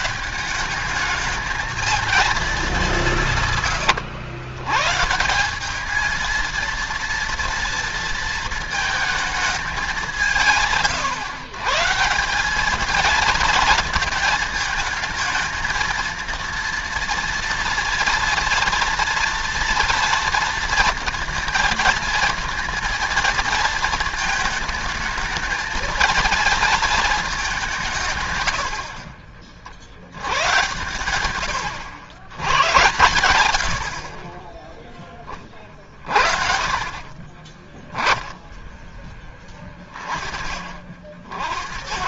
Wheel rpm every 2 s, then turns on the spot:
210, 190, 130, 230, 220, 140, 220, 220, 230, 240, 230, 230, 220, 220, 50, 110, 110, 10, 20, 10, 50.
32-34